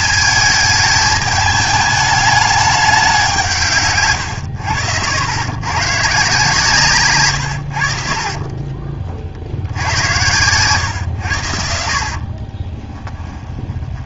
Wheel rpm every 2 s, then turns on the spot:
210, 200, 90, 150, 40, 120, 30.
8-10 12-14